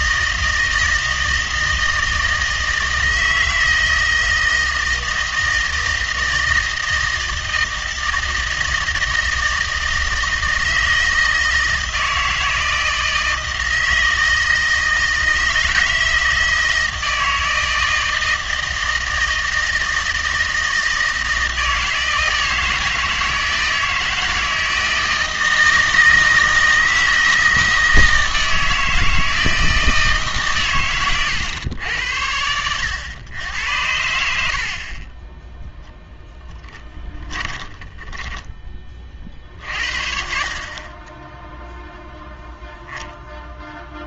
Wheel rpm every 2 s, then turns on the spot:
160, 160, 160, 160, 160, 160, 160, 160, 160, 160, 160, 160, 160, 160, 160, 130, 90, 60, 10, 20, 30, 0.
34-38